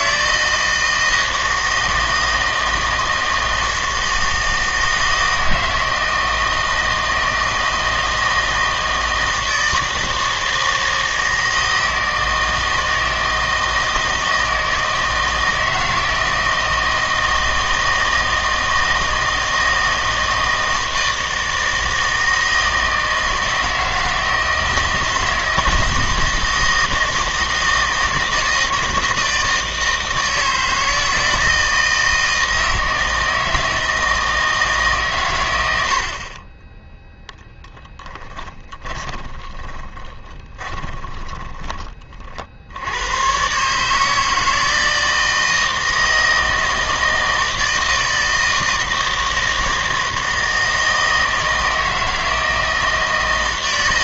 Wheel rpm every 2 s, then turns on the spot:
160, 160, 160, 160, 160, 160, 160, 160, 160, 160, 160, 160, 160, 160, 160, 160, 160, 150, 10, 20, 20, 70, 160, 160, 160, 160, 160.
38-42